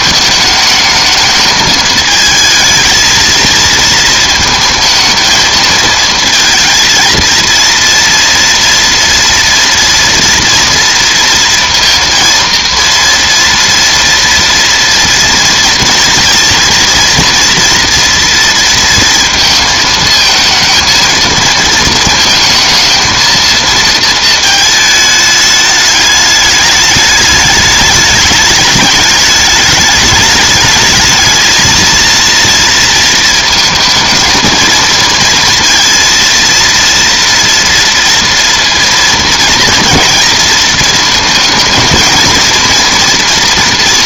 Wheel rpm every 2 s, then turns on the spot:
210, 220, 220, 220, 230, 230, 230, 230, 230, 230, 220, 220, 220, 210, 210, 210, 230, 220, 230, 230, 230, 230.
none